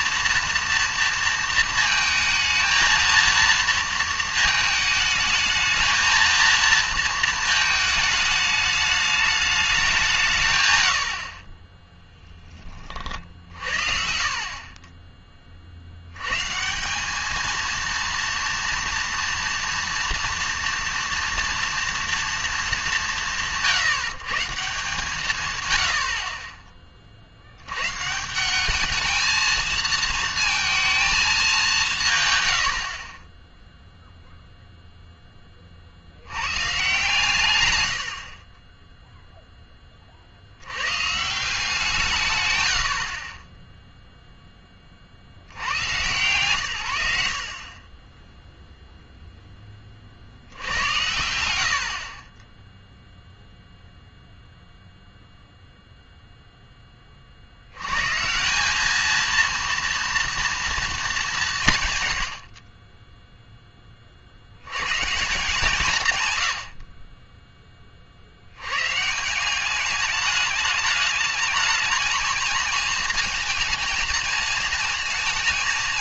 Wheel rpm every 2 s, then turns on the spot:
230, 220, 220, 230, 210, 130, 40, 20, 160, 230, 230, 190, 140, 20, 200, 220, 100, 0, 100, 30, 80, 100, 10, 100, 0, 70, 0, 0, 10, 190, 230, 20, 110, 100, 110, 210, 220, 230.
62-64